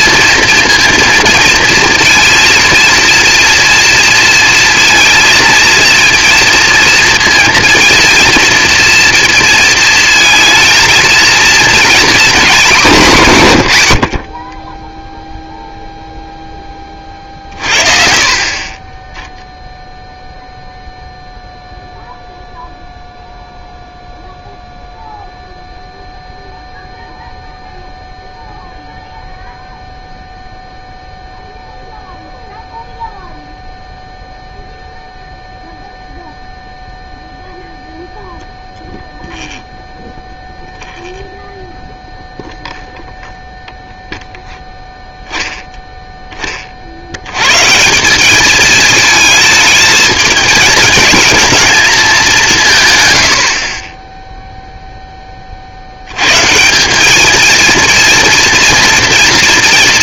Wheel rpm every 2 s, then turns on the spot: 230, 230, 230, 230, 230, 220, 210, 20, 20, 30, 0, 0, 0, 0, 0, 0, 0, 0, 0, 0, 0, 0, 0, 30, 210, 220, 180, 0, 150, 230.
18-20